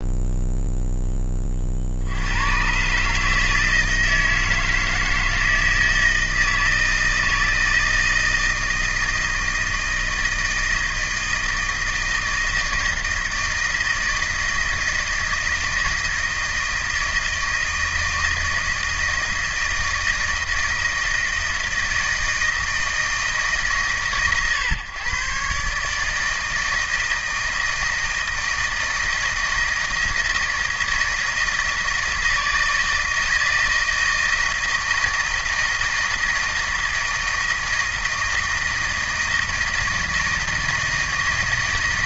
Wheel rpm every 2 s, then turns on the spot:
0, 120, 160, 160, 160, 160, 160, 160, 160, 160, 160, 160, 120, 160, 160, 160, 160, 160, 160, 160, 160.
none